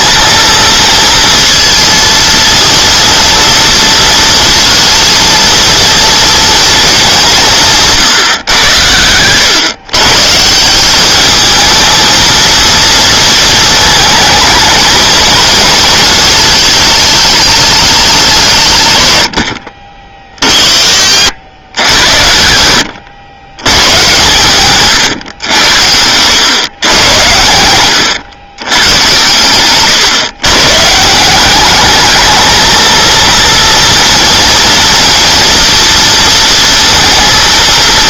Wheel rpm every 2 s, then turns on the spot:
230, 230, 230, 220, 110, 180, 230, 220, 220, 150, 50, 110, 130, 110, 120, 140, 220, 240, 230.
none